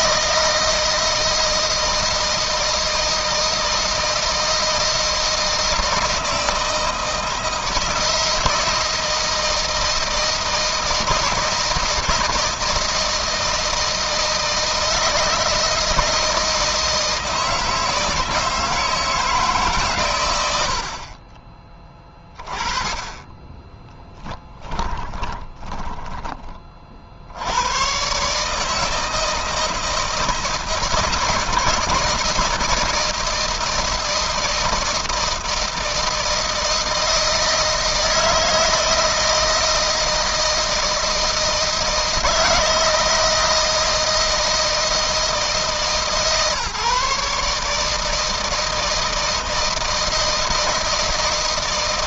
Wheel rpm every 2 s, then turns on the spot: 160, 160, 160, 160, 170, 160, 160, 160, 160, 160, 80, 30, 10, 40, 150, 160, 160, 160, 160, 160, 160, 160, 160, 150, 160, 160.
24-26